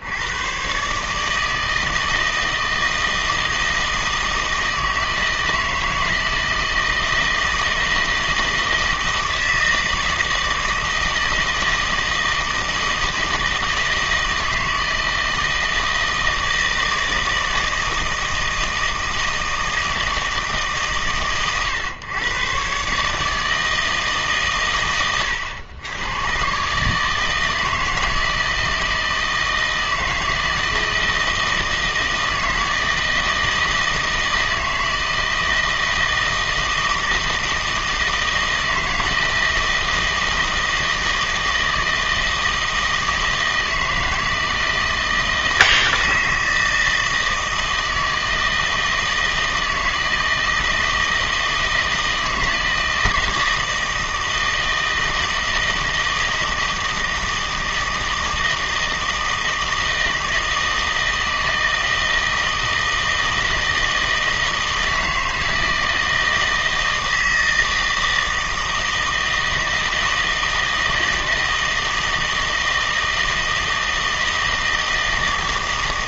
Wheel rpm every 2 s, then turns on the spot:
120, 160, 160, 160, 160, 160, 160, 160, 160, 160, 150, 130, 120, 140, 160, 160, 160, 160, 160, 160, 160, 160, 160, 160, 160, 160, 160, 160, 160, 160, 160, 160, 160, 160, 160, 160, 160, 160.
none